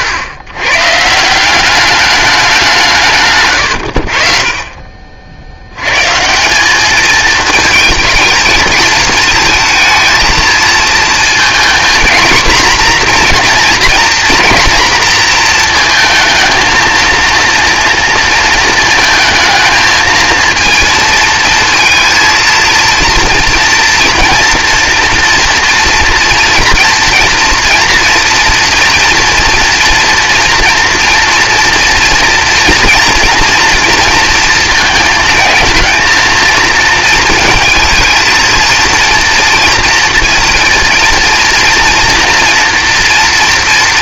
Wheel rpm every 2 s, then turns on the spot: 110, 170, 40, 210, 220, 230, 250, 230, 230, 220, 230, 230, 230, 230, 230, 240, 230, 230, 230, 230, 230, 230.
none